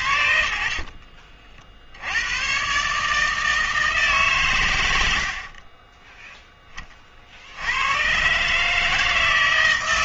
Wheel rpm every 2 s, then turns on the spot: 70, 120, 110, 30, 150.
none